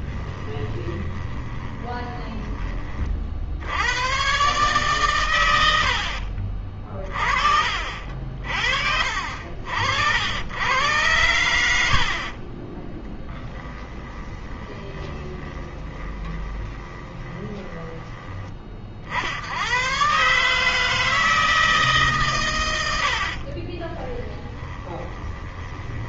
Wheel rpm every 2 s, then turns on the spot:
20, 30, 130, 40, 50, 110, 20, 20, 20, 40, 160, 100, 30.
0-2 12-18 22-26